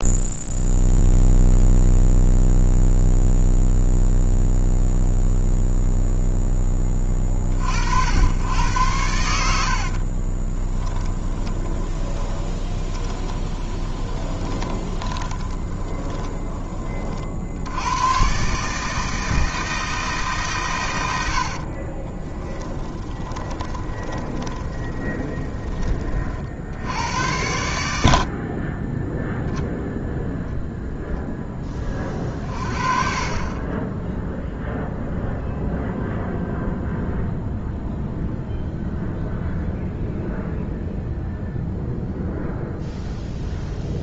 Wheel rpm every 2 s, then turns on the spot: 0, 0, 0, 10, 90, 20, 20, 20, 20, 140, 130, 10, 20, 70, 30, 0, 40, 0, 0, 0, 0, 0.
10-16 22-26